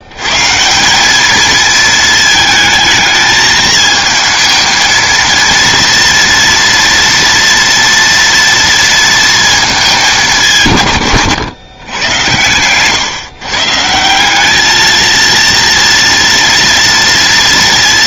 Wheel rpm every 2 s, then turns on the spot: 150, 220, 220, 230, 230, 160, 120, 210, 230.
none